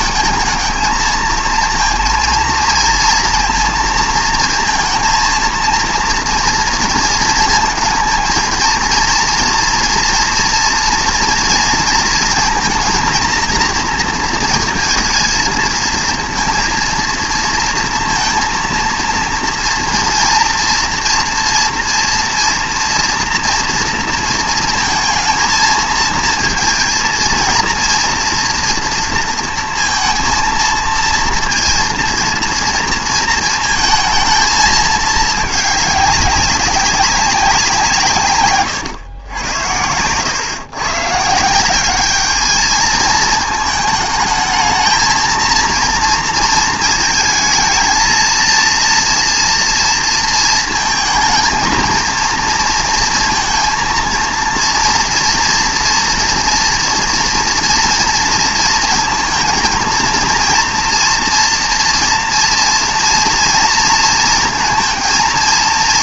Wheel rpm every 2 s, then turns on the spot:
220, 230, 220, 230, 230, 230, 230, 230, 230, 230, 240, 240, 230, 230, 230, 230, 230, 220, 190, 130, 130, 220, 220, 230, 230, 220, 230, 230, 230, 230, 230, 230, 230.
none